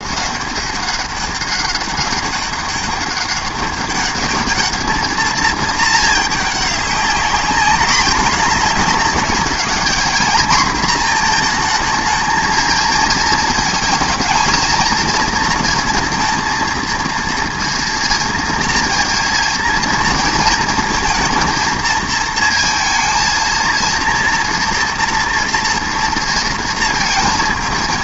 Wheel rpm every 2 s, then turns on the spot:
200, 200, 210, 210, 210, 230, 220, 230, 230, 230, 230, 230, 230, 230.
none